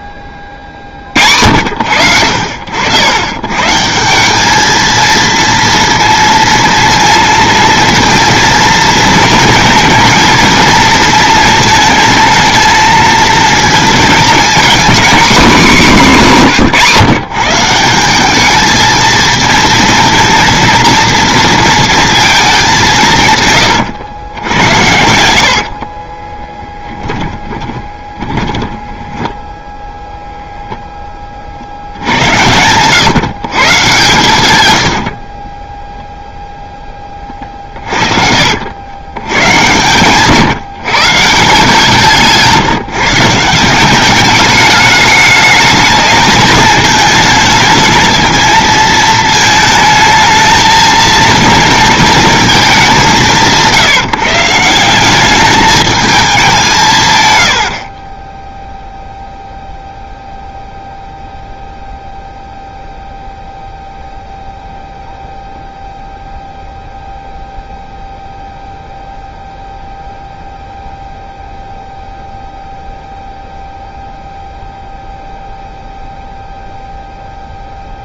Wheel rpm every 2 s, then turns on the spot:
60, 100, 230, 230, 230, 230, 230, 240, 150, 220, 230, 160, 80, 10, 10, 40, 140, 40, 60, 120, 170, 170, 210, 220, 220, 230, 170, 210, 60, 0, 0, 0, 0, 0, 0, 0, 0, 0, 0.
26-30 34-38